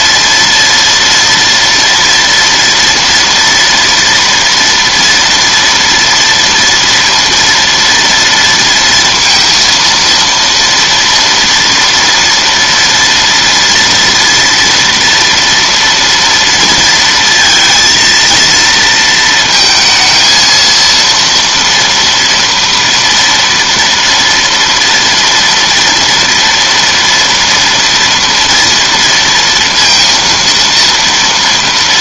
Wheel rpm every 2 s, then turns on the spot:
230, 240, 230, 230, 230, 230, 230, 230, 230, 230, 230, 230, 230, 230, 230, 230.
none